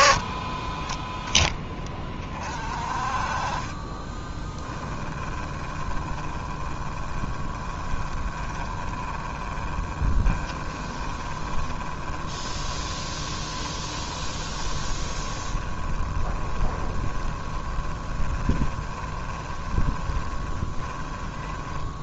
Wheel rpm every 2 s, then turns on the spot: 10, 30, 10, 20, 20, 20, 20, 20, 20, 20, 20.
4-22